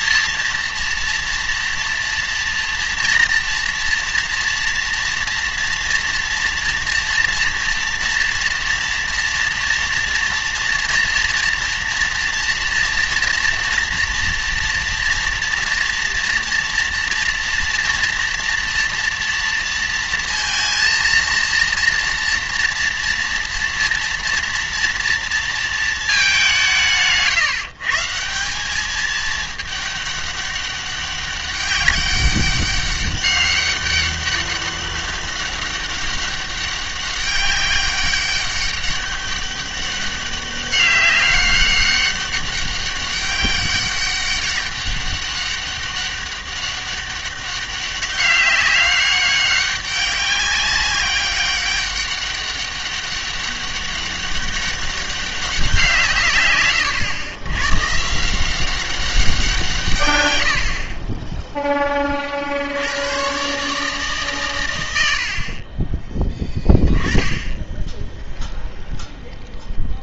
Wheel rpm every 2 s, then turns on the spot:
230, 240, 230, 230, 230, 230, 230, 230, 230, 230, 230, 230, 230, 160, 200, 200, 200, 200, 200, 200, 200, 200, 200, 200, 190, 190, 200, 200, 110, 190, 40, 80, 100, 10, 0.
none